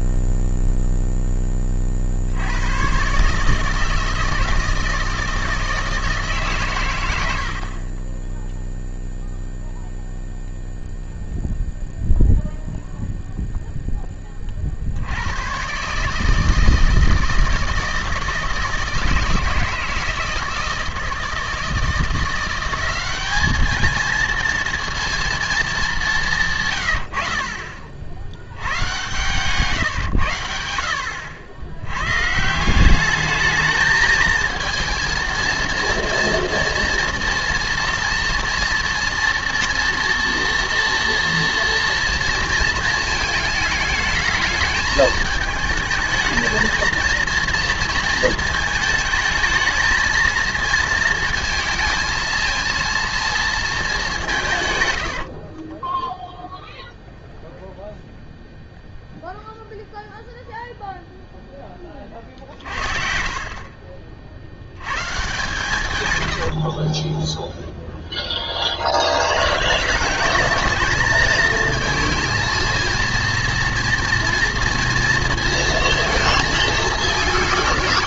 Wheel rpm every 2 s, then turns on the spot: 0, 90, 160, 130, 0, 0, 0, 40, 160, 160, 160, 180, 230, 130, 90, 80, 160, 230, 230, 230, 240, 230, 220, 230, 220, 220, 220, 140, 0, 0, 0, 50, 70, 60, 30, 210, 230, 230, 220.
26-28 66-68